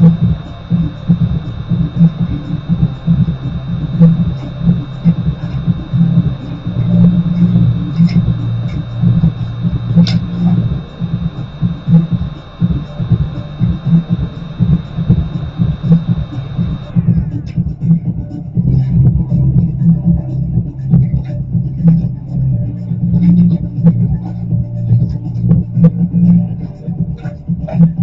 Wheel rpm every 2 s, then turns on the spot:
0, 0, 0, 0, 0, 0, 0, 0, 0, 0, 0, 0, 0, 0.
none